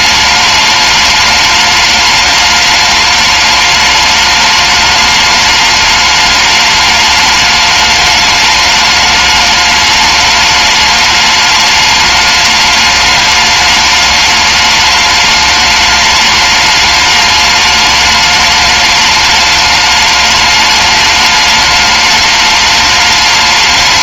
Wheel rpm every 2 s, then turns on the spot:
210, 210, 210, 210, 210, 210, 210, 210, 210, 210, 210, 210.
none